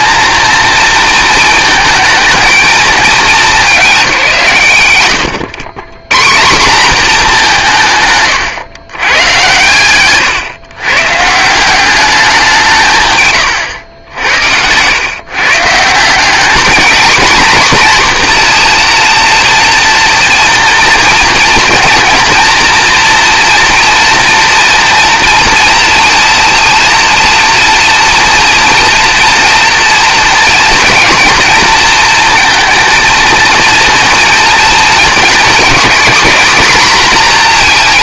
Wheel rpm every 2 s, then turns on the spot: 220, 210, 120, 200, 110, 130, 160, 110, 220, 240, 230, 230, 230, 230, 240, 230, 230, 230, 240.
none